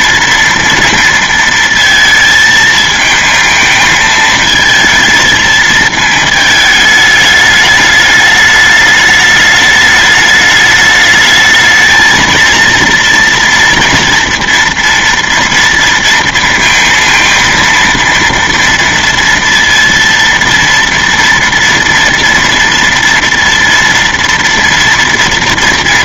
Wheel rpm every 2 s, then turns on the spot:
230, 220, 220, 220, 210, 210, 230, 230, 230, 230, 230, 230, 230.
none